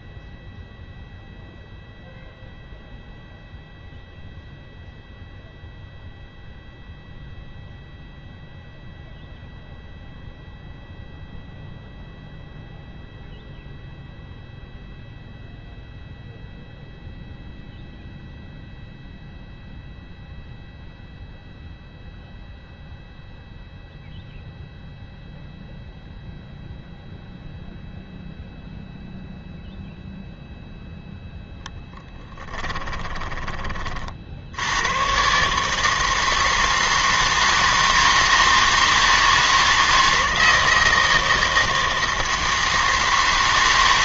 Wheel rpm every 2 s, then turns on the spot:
0, 0, 0, 0, 0, 0, 0, 0, 0, 0, 0, 0, 0, 0, 0, 0, 20, 90, 160, 160, 160, 160.
32-34